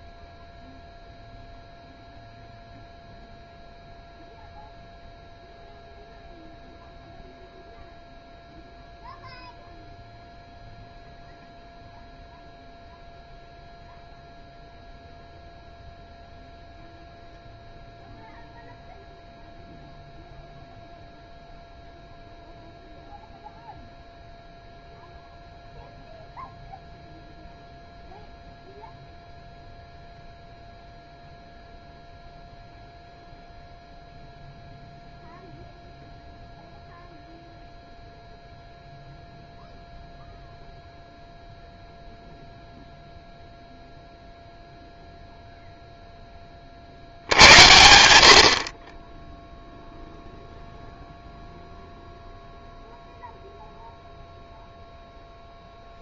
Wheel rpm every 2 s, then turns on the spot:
0, 0, 0, 0, 0, 0, 0, 0, 0, 0, 0, 0, 0, 0, 0, 0, 0, 0, 0, 0, 0, 0, 0, 60, 30, 0, 0, 0.
none